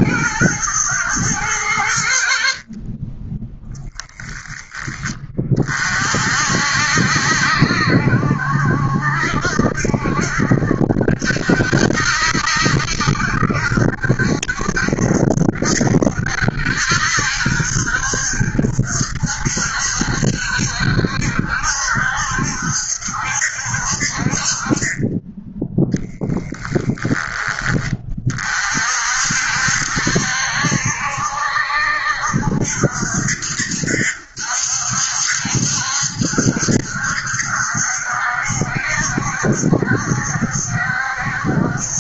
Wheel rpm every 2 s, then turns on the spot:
110, 30, 30, 60, 70, 70, 70, 70, 70, 70, 70, 70, 20, 0, 50, 70, 70, 70, 70, 70, 70.
none